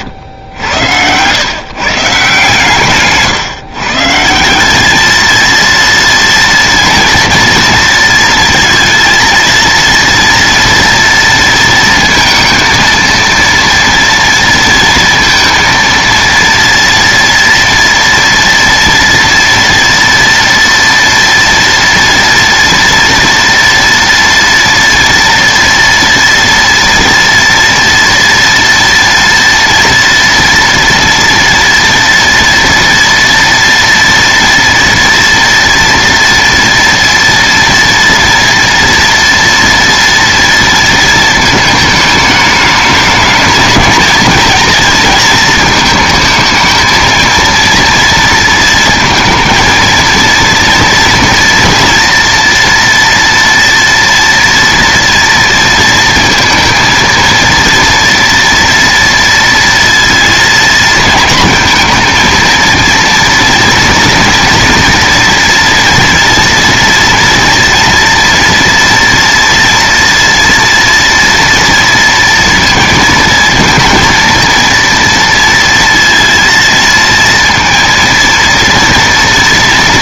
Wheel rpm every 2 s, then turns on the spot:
100, 140, 210, 230, 230, 230, 230, 230, 230, 230, 230, 230, 240, 230, 230, 230, 230, 230, 230, 230, 230, 210, 220, 220, 230, 240, 230, 240, 230, 230, 220, 230, 230, 230, 230, 230, 230, 230, 230, 230.
none